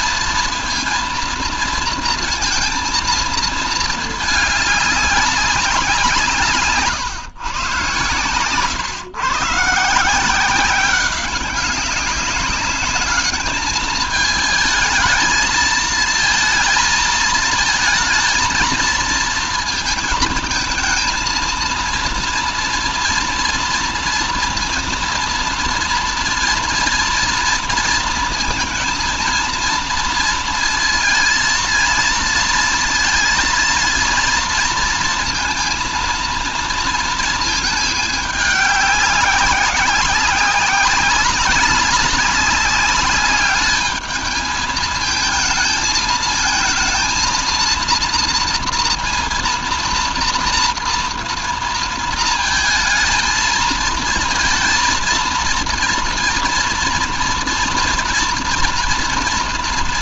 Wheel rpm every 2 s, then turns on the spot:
230, 230, 210, 140, 130, 180, 200, 220, 220, 230, 220, 230, 230, 230, 230, 230, 230, 230, 230, 200, 190, 200, 220, 220, 230, 230, 230, 230, 230, 230.
6-8